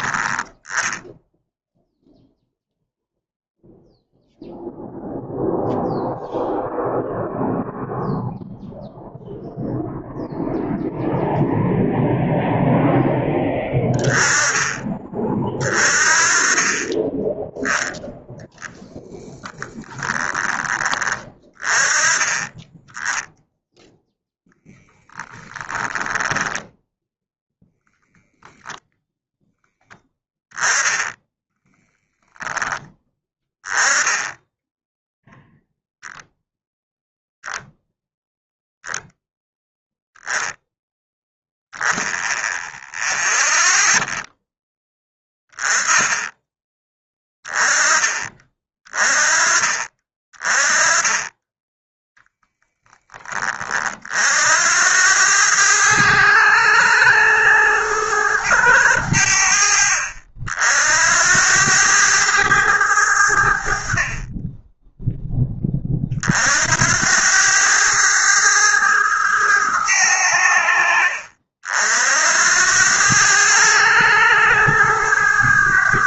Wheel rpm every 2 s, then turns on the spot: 0, 0, 0, 0, 0, 0, 10, 20, 20, 10, 20, 10, 0, 0, 0, 10, 10, 0, 0, 0, 10, 0, 10, 20, 30, 20, 10, 80, 100, 90, 80, 80, 10, 80, 110, 50, 90, 110.
16-18